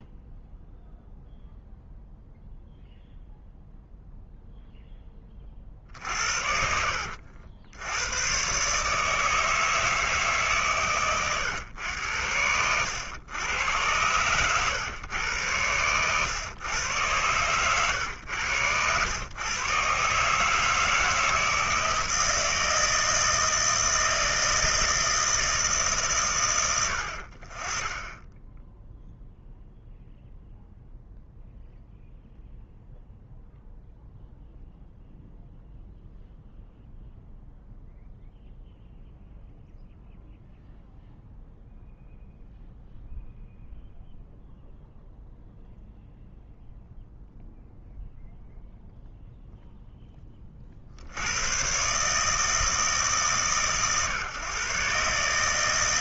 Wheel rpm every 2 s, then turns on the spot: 0, 0, 0, 70, 140, 140, 90, 110, 110, 110, 160, 160, 160, 90, 10, 0, 0, 0, 0, 0, 0, 0, 0, 0, 0, 50, 150, 130.
none